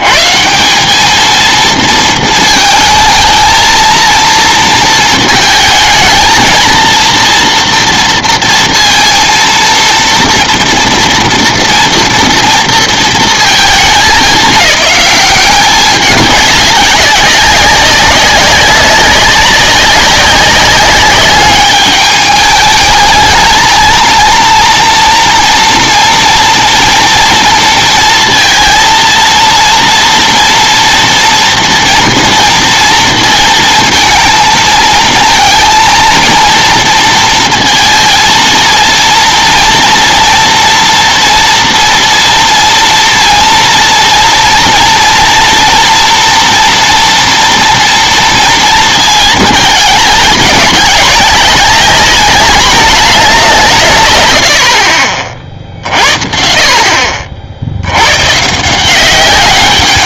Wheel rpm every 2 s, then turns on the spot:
160, 220, 230, 230, 230, 230, 230, 190, 200, 190, 200, 210, 230, 230, 230, 240, 230, 230, 230, 230, 230, 230, 230, 240, 230, 210, 200, 90, 60, 150.
none